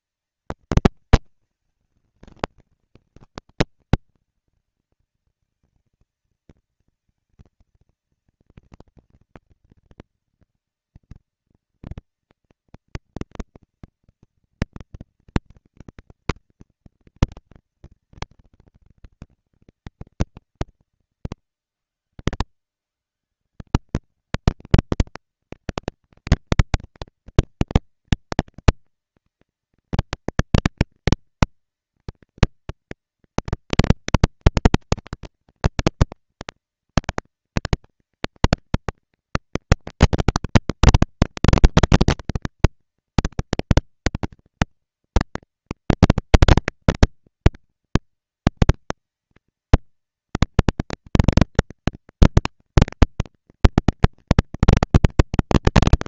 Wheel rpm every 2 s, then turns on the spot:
230, 210, 220, 230, 230, 230, 240, 230, 230, 210, 150, 120, 220, 230, 230, 230, 240, 220, 230, 230, 230, 230, 230, 230, 220, 230, 230, 230.
none